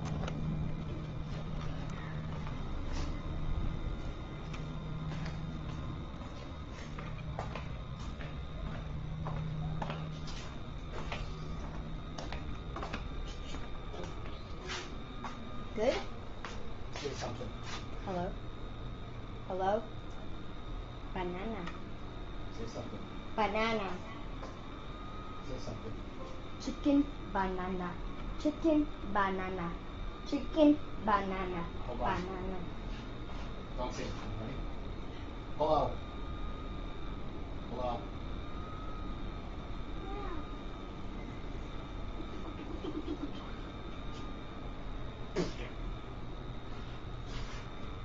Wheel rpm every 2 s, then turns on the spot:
0, 0, 0, 0, 0, 0, 0, 0, 0, 0, 0, 0, 0, 0, 0, 0, 0, 0, 0, 0, 0, 0, 0, 0.
none